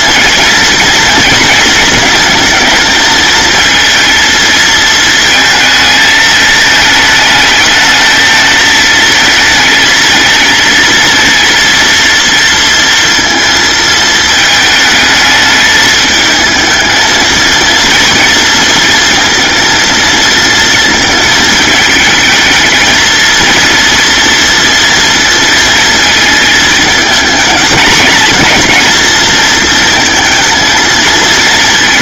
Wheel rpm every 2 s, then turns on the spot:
230, 220, 220, 210, 220, 230, 230, 220, 220, 230, 220, 230, 230, 220, 230, 220.
none